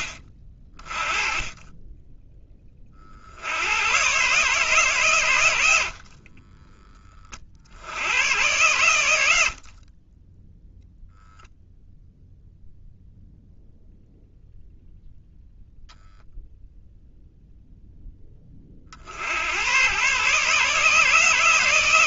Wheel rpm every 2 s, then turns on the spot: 40, 30, 130, 20, 100, 0, 0, 0, 0, 40, 150.
none